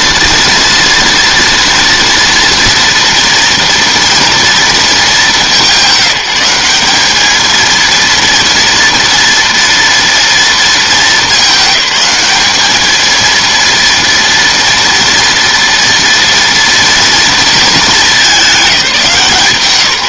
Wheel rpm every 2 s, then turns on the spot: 230, 230, 230, 190, 230, 220, 210, 230, 230, 200.
none